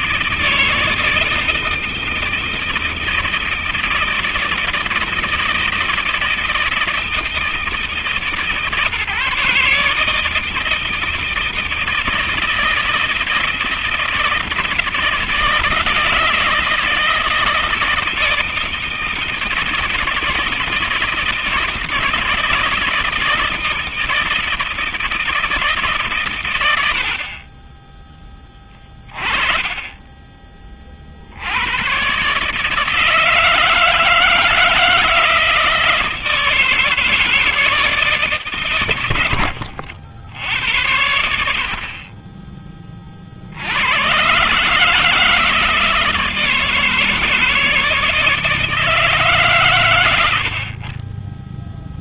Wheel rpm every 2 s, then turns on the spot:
160, 160, 160, 160, 140, 160, 160, 160, 160, 160, 160, 160, 160, 100, 20, 20, 140, 160, 160, 120, 90, 40, 150, 160, 150, 30.
none